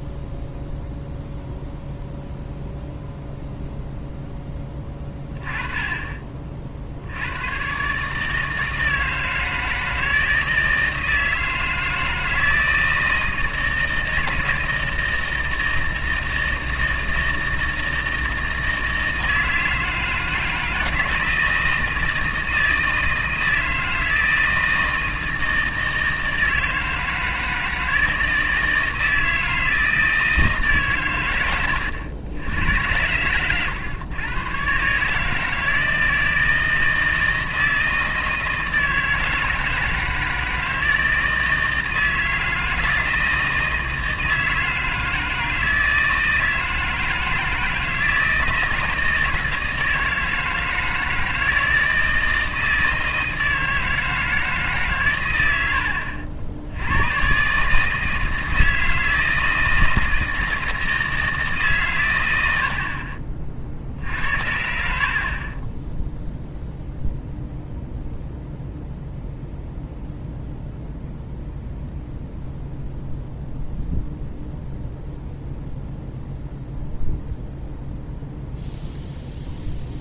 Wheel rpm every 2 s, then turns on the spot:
0, 0, 20, 60, 160, 160, 160, 160, 160, 160, 160, 160, 160, 160, 160, 140, 90, 130, 160, 160, 160, 160, 160, 160, 160, 160, 160, 140, 90, 160, 160, 60, 60, 0, 0, 0, 0, 0, 0, 0.
none